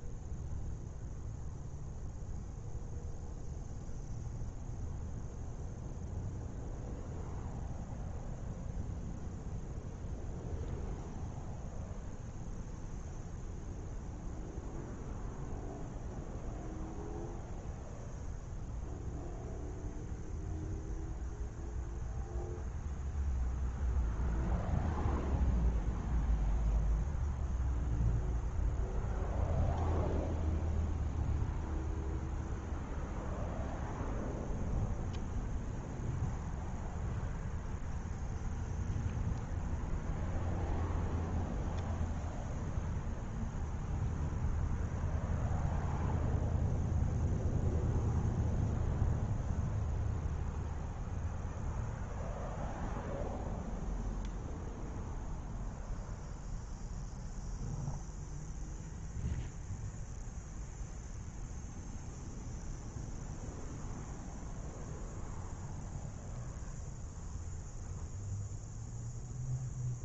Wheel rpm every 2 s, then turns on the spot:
0, 0, 0, 0, 0, 0, 0, 0, 0, 0, 0, 0, 0, 0, 0, 0, 0, 0, 0, 0, 0, 0, 0, 0, 0, 0, 0, 0, 0, 0, 0, 0, 0, 0, 0.
none